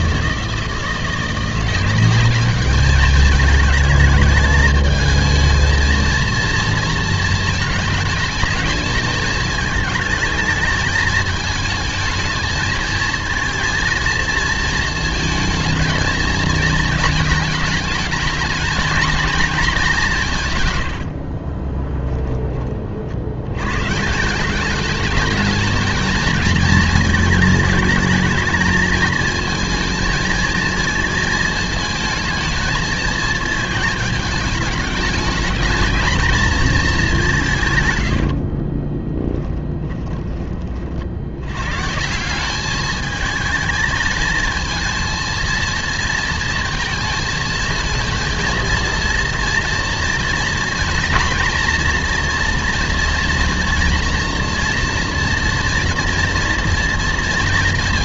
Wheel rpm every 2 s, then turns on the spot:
170, 210, 220, 230, 220, 220, 220, 220, 220, 230, 90, 60, 210, 220, 220, 220, 230, 210, 200, 20, 50, 210, 230, 220, 230, 230, 240, 230, 230.
20-22 38-40